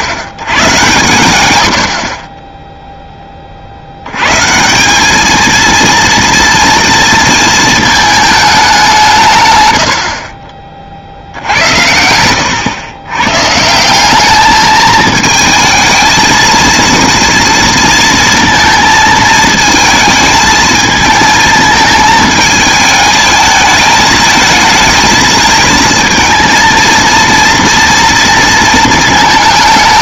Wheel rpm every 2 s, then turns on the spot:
90, 10, 160, 230, 200, 30, 100, 220, 230, 230, 220, 220, 220, 230, 230.
none